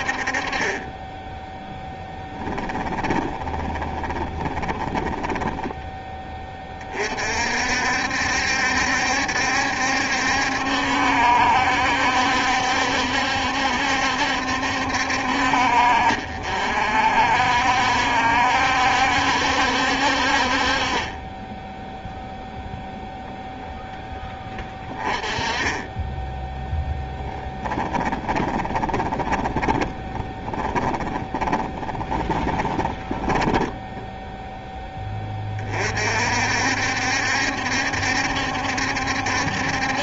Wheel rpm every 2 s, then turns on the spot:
20, 20, 20, 40, 70, 70, 70, 60, 60, 70, 40, 0, 20, 10, 20, 20, 20, 10, 70, 60.
2-6 26-34